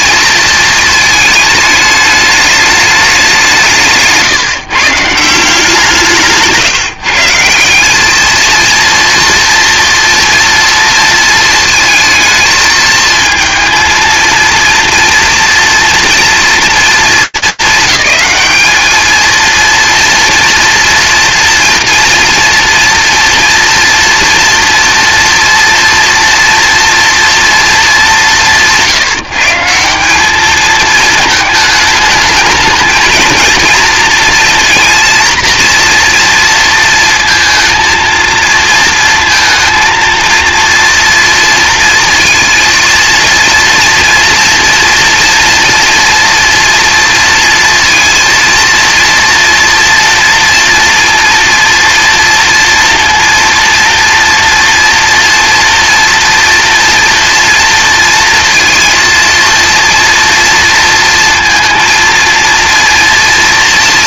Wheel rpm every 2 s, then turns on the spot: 220, 200, 160, 160, 230, 230, 220, 230, 220, 210, 230, 230, 230, 240, 160, 220, 220, 230, 230, 230, 240, 230, 230, 230, 230, 230, 230, 230, 230, 230, 230, 230.
none